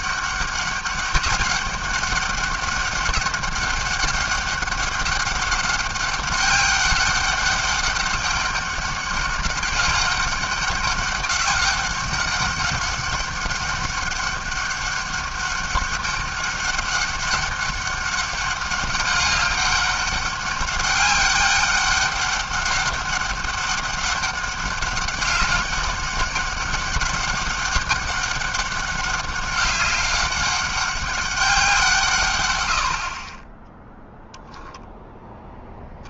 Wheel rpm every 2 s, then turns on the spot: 190, 190, 200, 200, 200, 200, 200, 200, 200, 200, 200, 200, 200, 200, 200, 200, 110, 20.
none